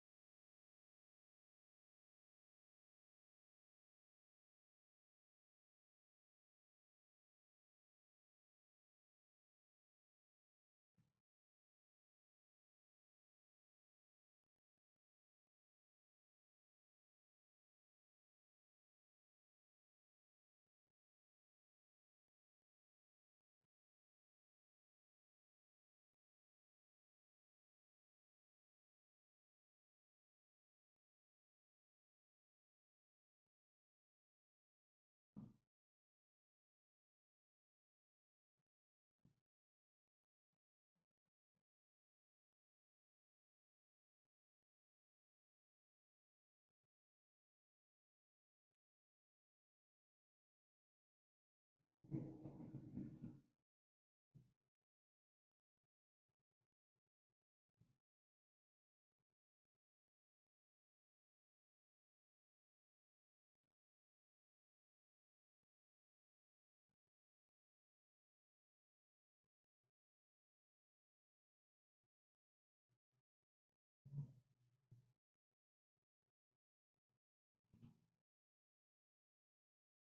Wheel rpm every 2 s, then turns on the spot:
0, 0, 0, 0, 0, 0, 0, 0, 0, 0, 0, 0, 0, 0, 0, 0, 0, 0, 0, 0, 0, 0, 0, 0, 0, 0, 0, 0, 0, 0, 0, 0, 0, 0, 0, 0, 0, 0, 0, 0.
none